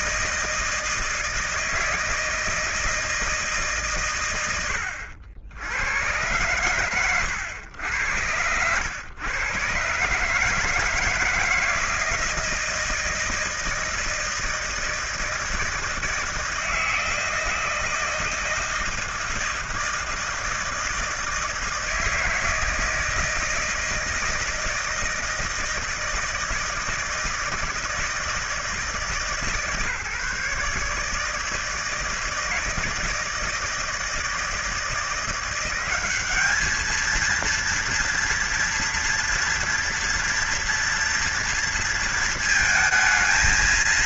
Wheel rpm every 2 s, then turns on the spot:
160, 160, 80, 110, 100, 160, 160, 160, 160, 160, 160, 160, 160, 160, 160, 150, 160, 160, 210, 240, 230, 220.
none